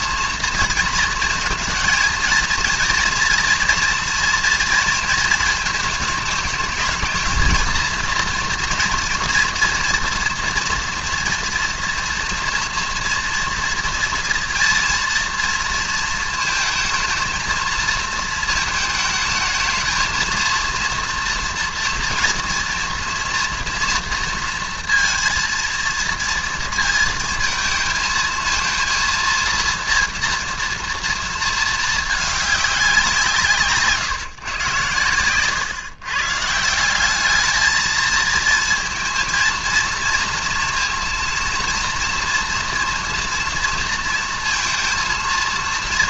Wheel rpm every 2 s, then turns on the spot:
220, 230, 230, 210, 230, 230, 230, 230, 230, 220, 230, 240, 230, 230, 230, 230, 200, 130, 170, 230, 230, 230, 230.
none